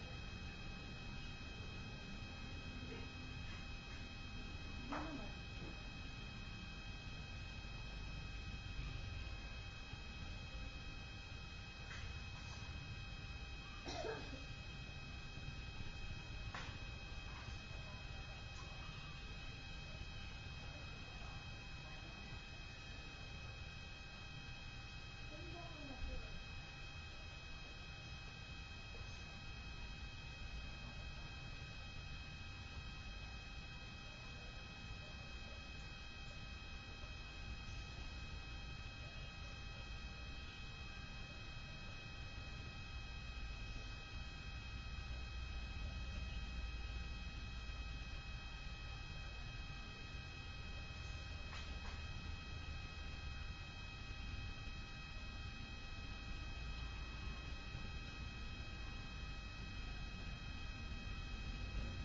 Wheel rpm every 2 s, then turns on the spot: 0, 0, 0, 0, 0, 0, 0, 0, 0, 0, 0, 0, 0, 0, 0, 0, 0, 0, 0, 0, 0, 0, 0, 0, 0, 0, 0, 0, 0, 0, 0.
none